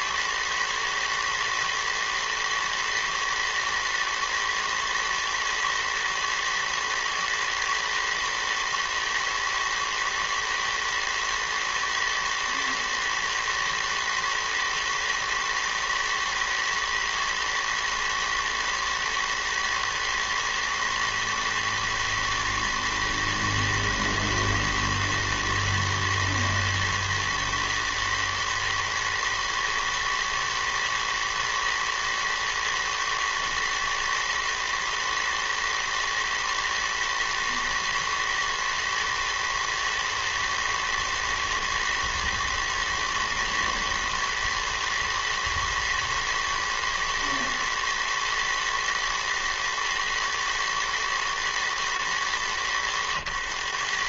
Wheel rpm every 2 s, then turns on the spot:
110, 110, 110, 110, 110, 110, 110, 110, 110, 120, 110, 110, 110, 110, 110, 110, 110, 110, 110, 110, 110, 110, 110, 120, 110, 110, 90.
none